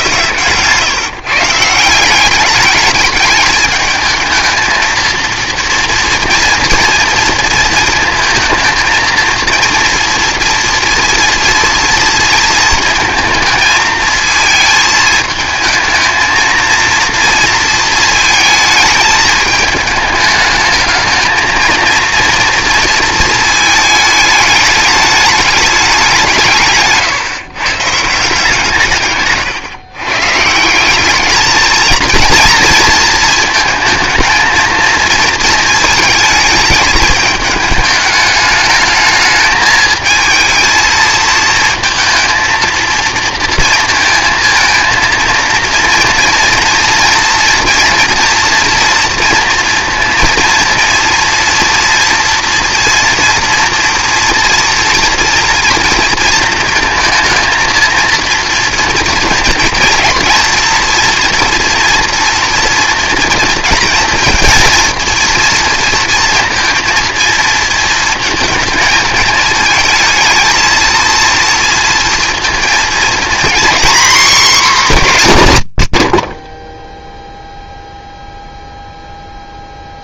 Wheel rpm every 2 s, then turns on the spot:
140, 200, 230, 230, 230, 230, 230, 220, 220, 220, 220, 230, 210, 160, 150, 160, 230, 230, 220, 210, 220, 230, 230, 230, 240, 230, 240, 240, 230, 230, 230, 230, 230, 230, 230, 230, 230, 250, 30, 0.
none